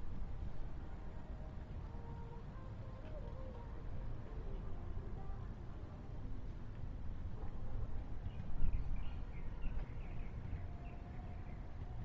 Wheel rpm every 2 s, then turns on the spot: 0, 0, 0, 0, 0, 0.
none